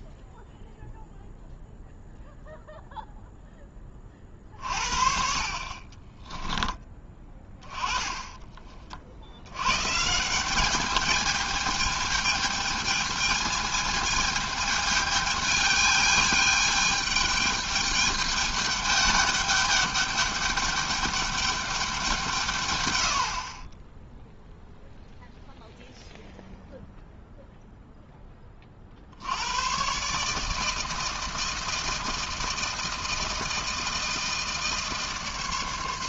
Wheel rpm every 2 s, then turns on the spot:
0, 0, 50, 10, 30, 200, 220, 220, 210, 200, 210, 130, 0, 0, 40, 160, 160, 160.
none